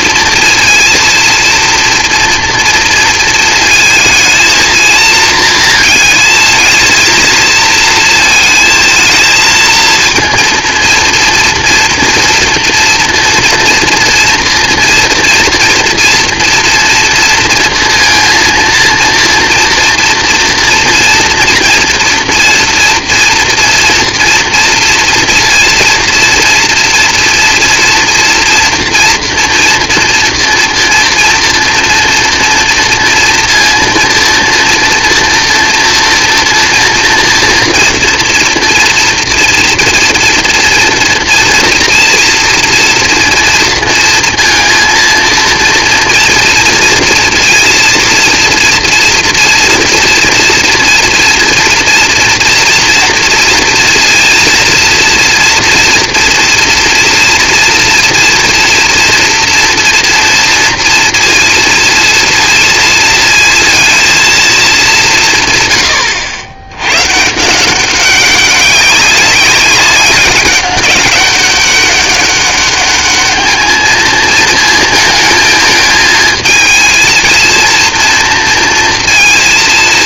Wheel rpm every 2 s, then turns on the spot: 230, 230, 230, 230, 230, 240, 230, 230, 230, 230, 230, 230, 230, 230, 230, 230, 230, 230, 230, 240, 230, 230, 230, 230, 230, 240, 240, 230, 240, 240, 230, 230, 190, 120, 200, 200, 210, 220, 230, 230.
none